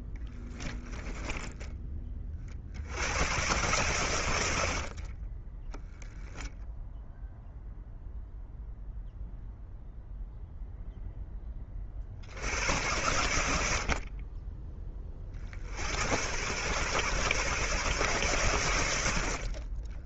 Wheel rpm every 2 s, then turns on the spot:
10, 70, 70, 0, 0, 0, 90, 20, 120, 100.
0-2 4-6